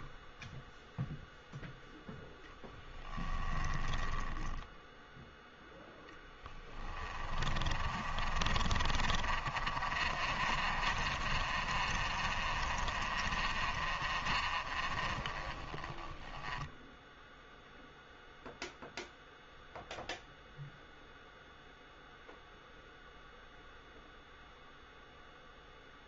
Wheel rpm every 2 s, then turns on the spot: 0, 10, 10, 10, 40, 40, 40, 40, 10, 0, 0, 0, 0.
2-16